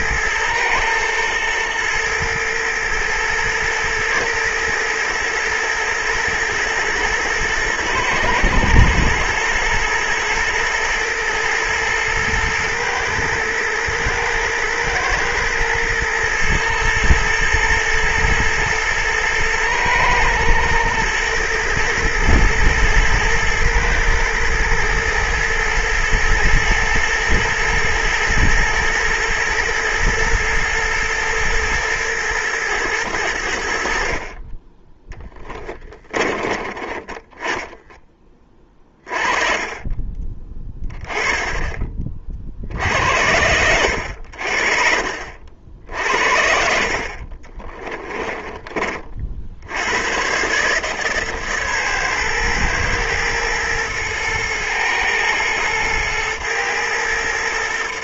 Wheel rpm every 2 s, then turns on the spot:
110, 110, 120, 110, 120, 120, 110, 110, 120, 120, 110, 110, 110, 120, 110, 110, 100, 10, 20, 30, 20, 70, 50, 50, 40, 150, 110, 110, 110.
36-38